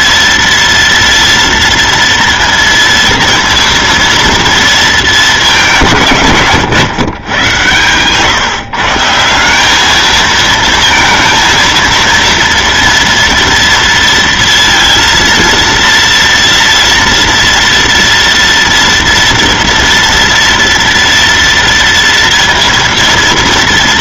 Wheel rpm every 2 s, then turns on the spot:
230, 230, 230, 160, 130, 220, 230, 230, 230, 230, 230, 230.
none